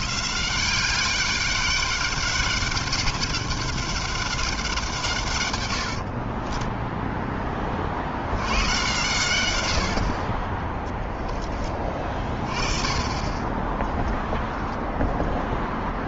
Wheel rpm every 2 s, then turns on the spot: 200, 200, 130, 10, 110, 20, 20, 0.
none